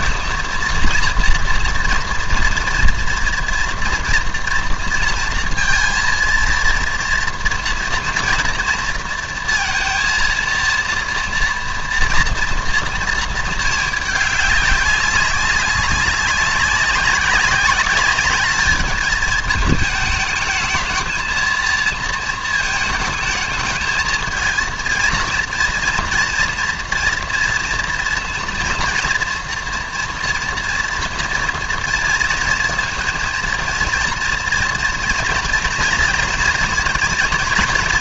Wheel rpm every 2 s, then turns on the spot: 230, 230, 240, 230, 230, 230, 230, 200, 190, 210, 220, 220, 230, 230, 230, 230, 230, 230, 230.
none